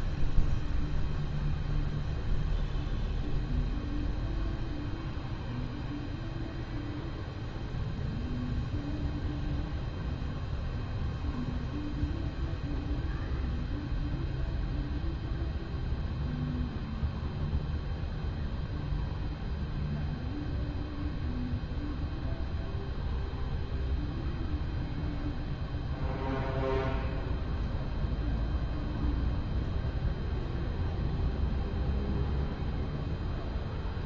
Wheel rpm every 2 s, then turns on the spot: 0, 0, 0, 0, 0, 0, 0, 0, 0, 0, 0, 0, 0, 0, 0, 0, 0.
none